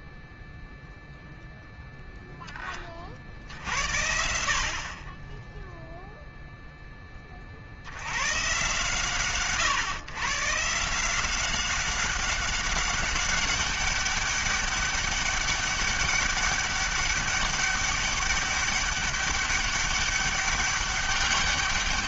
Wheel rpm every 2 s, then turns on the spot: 0, 10, 50, 0, 120, 150, 200, 200, 200, 200, 200.
none